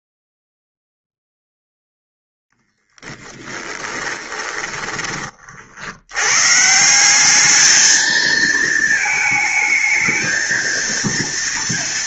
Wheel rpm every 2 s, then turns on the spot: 0, 0, 20, 130, 220, 230.
4-6